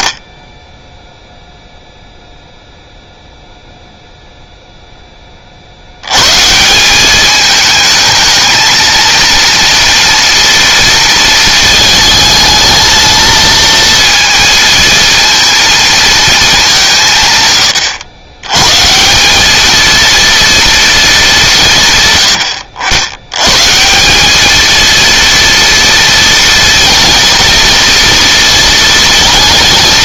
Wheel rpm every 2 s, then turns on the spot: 10, 0, 0, 190, 230, 230, 220, 220, 170, 150, 220, 80, 230, 230, 230.
none